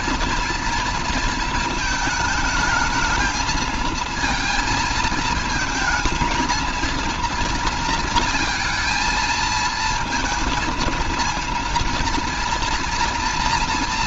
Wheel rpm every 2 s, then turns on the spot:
230, 220, 230, 230, 230, 230, 230.
none